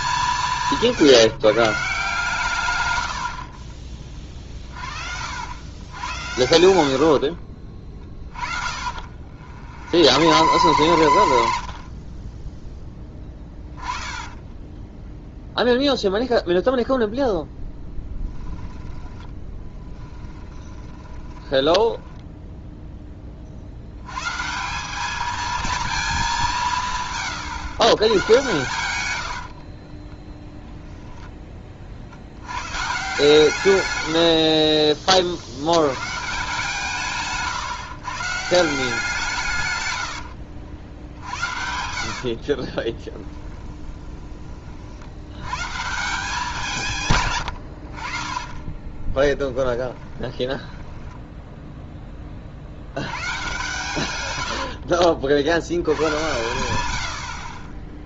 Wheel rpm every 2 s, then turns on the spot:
170, 140, 40, 80, 30, 110, 10, 10, 0, 10, 10, 0, 160, 170, 120, 0, 110, 50, 160, 180, 80, 30, 30, 170, 20, 20, 60, 80, 90.
8-12 18-22 34-36 40-44 48-52 54-56